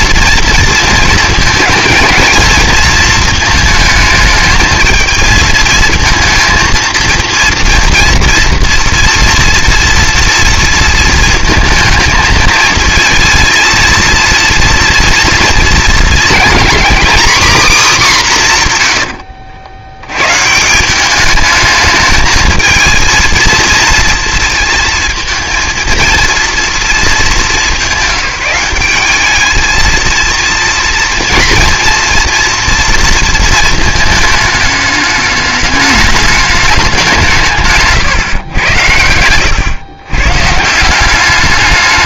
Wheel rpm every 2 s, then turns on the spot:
230, 220, 220, 230, 230, 230, 230, 240, 250, 130, 170, 220, 230, 230, 200, 230, 230, 220, 200, 100, 160.
none